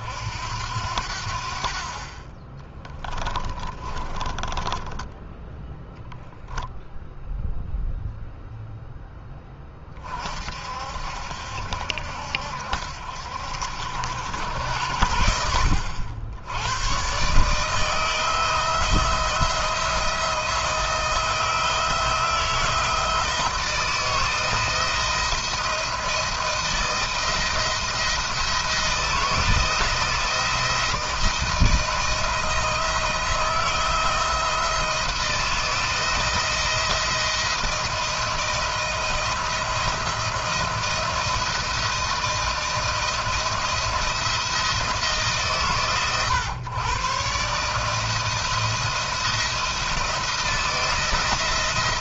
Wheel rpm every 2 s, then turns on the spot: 70, 20, 10, 0, 0, 60, 70, 90, 100, 160, 170, 160, 160, 170, 160, 160, 160, 170, 170, 170, 170, 160, 160, 120, 170, 170.
2-6